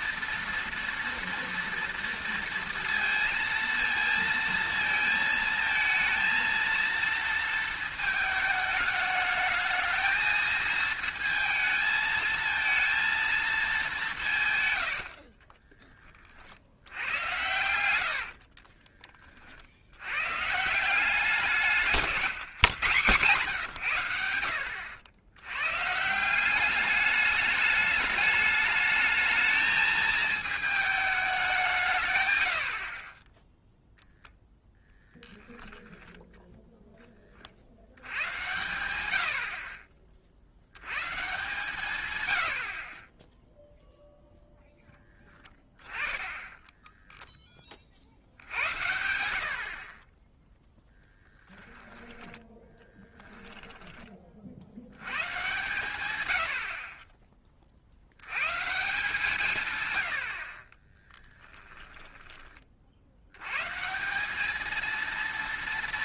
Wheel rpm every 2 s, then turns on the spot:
230, 230, 230, 230, 220, 220, 220, 140, 60, 40, 140, 140, 80, 190, 210, 220, 70, 0, 0, 100, 70, 80, 0, 10, 80, 0, 10, 60, 70, 120, 50, 30, 210.
18-20 52-54